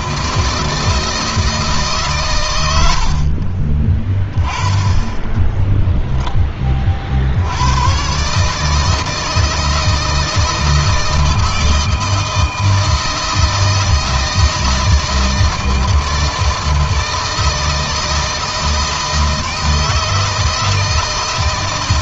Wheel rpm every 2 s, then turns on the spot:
160, 90, 10, 30, 150, 160, 160, 160, 160, 160, 160.
none